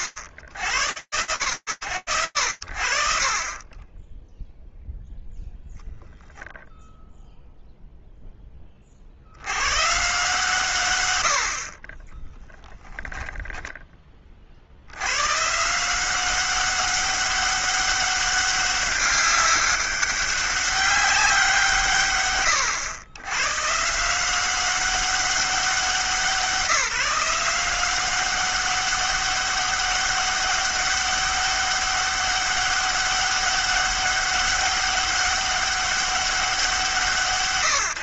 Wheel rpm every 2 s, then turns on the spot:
50, 60, 0, 0, 40, 100, 10, 110, 200, 200, 190, 110, 190, 180, 200, 200, 200, 200, 140.
none